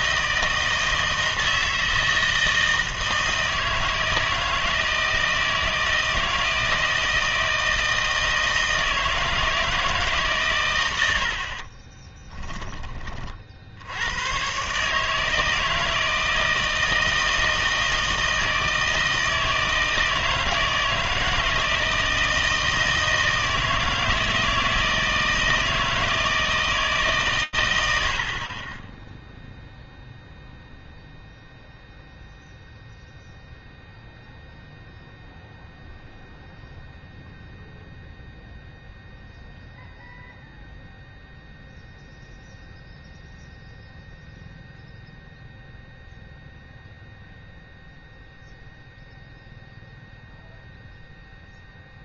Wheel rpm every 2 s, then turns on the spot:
160, 160, 160, 160, 160, 110, 10, 130, 160, 160, 160, 160, 160, 160, 30, 0, 0, 0, 0, 0, 0, 0, 0, 0, 0, 0.
none